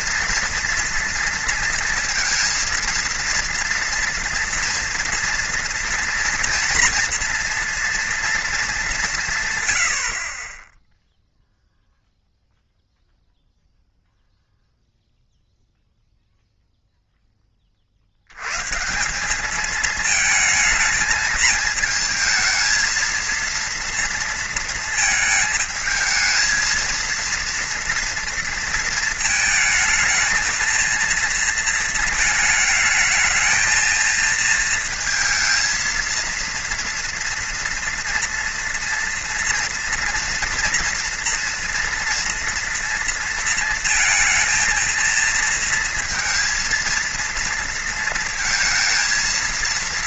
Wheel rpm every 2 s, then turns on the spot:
230, 230, 230, 230, 210, 20, 0, 0, 0, 140, 220, 220, 230, 220, 230, 230, 220, 230, 230, 230, 240, 230, 230, 230, 230.
none